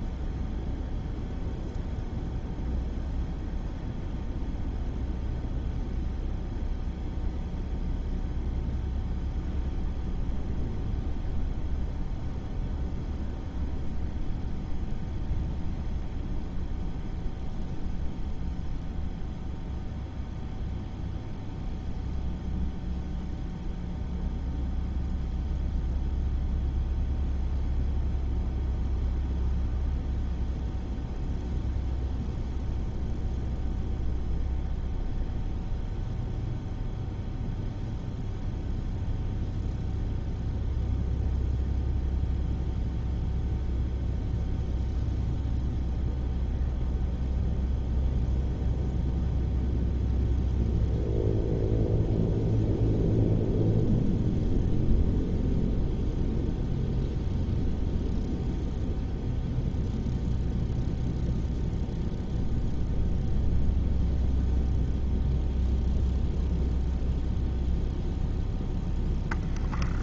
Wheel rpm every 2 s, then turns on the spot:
0, 0, 0, 0, 0, 0, 0, 0, 0, 0, 0, 0, 0, 0, 0, 0, 0, 0, 0, 0, 0, 0, 0, 0, 0, 0, 0, 0, 0, 0, 0, 0, 0, 0, 0.
none